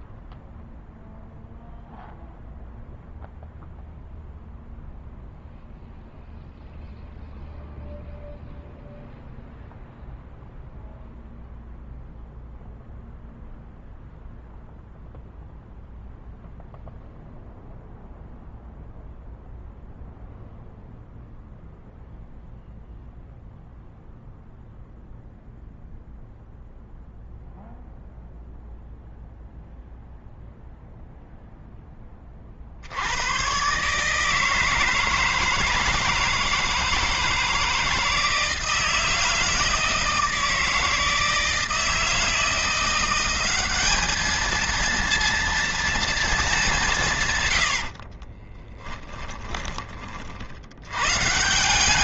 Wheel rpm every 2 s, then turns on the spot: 0, 0, 0, 0, 0, 0, 0, 0, 0, 0, 0, 0, 0, 0, 0, 0, 60, 160, 160, 160, 160, 170, 230, 180, 20, 100.
48-50